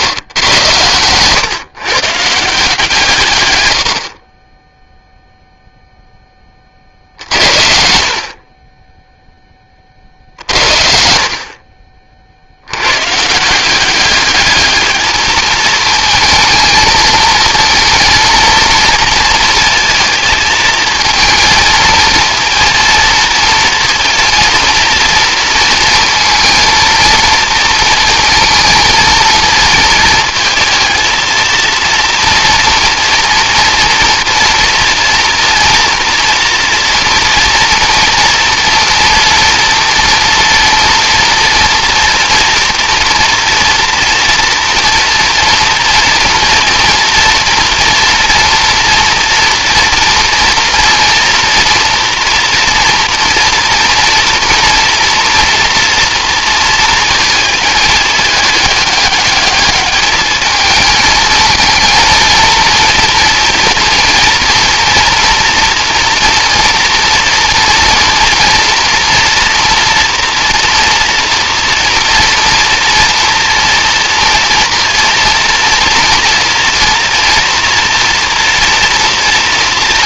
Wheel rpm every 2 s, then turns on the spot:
110, 150, 20, 40, 30, 60, 130, 210, 230, 230, 230, 230, 230, 230, 230, 230, 230, 230, 230, 230, 230, 230, 230, 230, 230, 230, 230, 240, 230, 210, 220, 230, 230, 240, 230, 230, 230, 230, 230, 230.
10-12